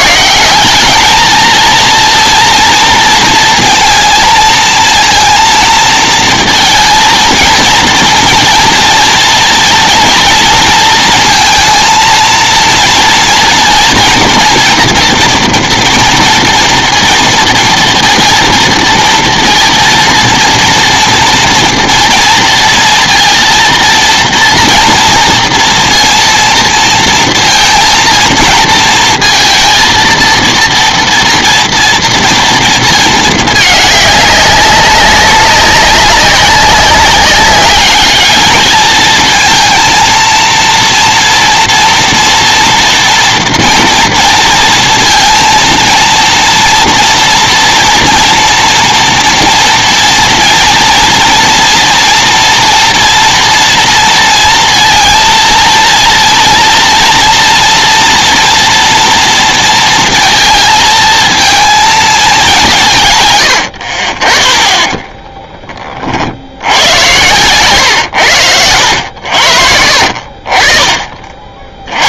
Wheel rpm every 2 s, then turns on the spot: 150, 230, 230, 230, 230, 230, 230, 240, 230, 230, 230, 230, 230, 230, 230, 230, 230, 200, 190, 210, 230, 230, 230, 230, 230, 230, 230, 230, 230, 240, 230, 220, 50, 50, 110, 50.
64-66